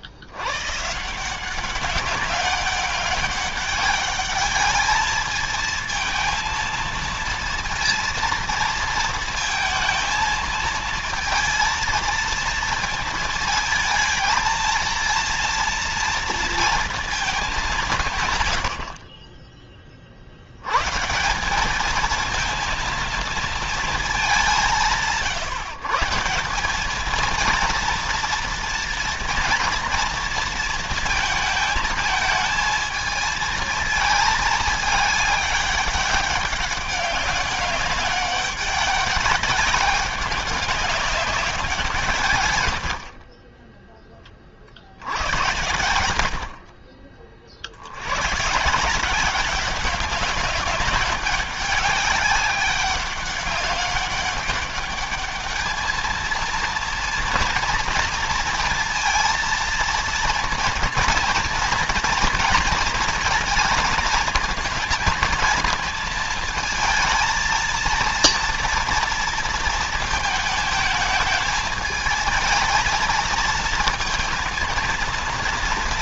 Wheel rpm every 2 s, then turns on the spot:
140, 190, 210, 230, 230, 230, 230, 230, 230, 70, 130, 230, 170, 210, 230, 230, 220, 210, 200, 200, 190, 90, 80, 50, 180, 200, 200, 200, 230, 230, 230, 230, 230, 220, 230, 220, 220, 230.
42-44